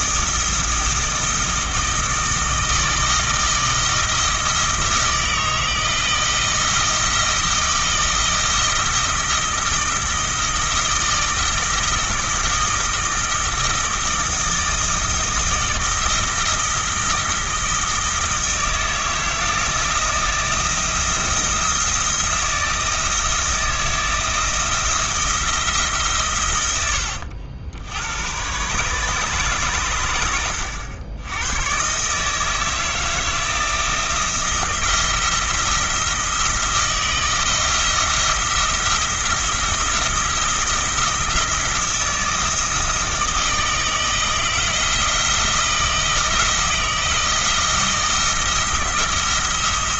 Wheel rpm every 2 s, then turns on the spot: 160, 160, 160, 160, 170, 160, 160, 160, 160, 170, 170, 160, 170, 100, 130, 90, 160, 170, 170, 170, 170, 160, 160, 160, 160.
26-28